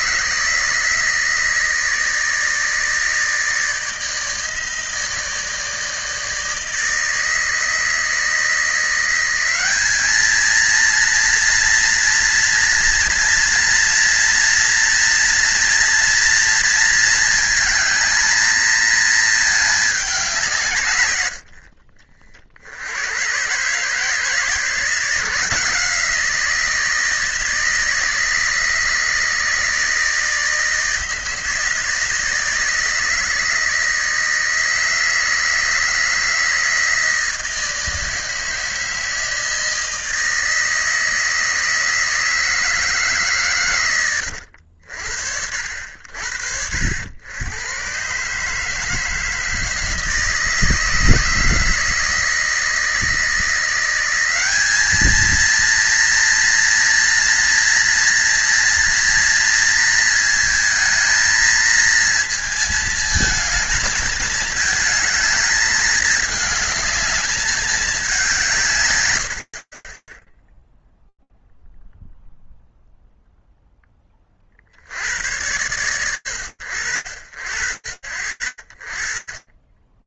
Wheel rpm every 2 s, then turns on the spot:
160, 160, 160, 160, 190, 240, 230, 230, 220, 220, 60, 120, 170, 160, 160, 160, 160, 160, 160, 160, 160, 140, 60, 90, 160, 160, 170, 230, 230, 230, 220, 220, 220, 210, 80, 0, 30, 70, 70, 20.
none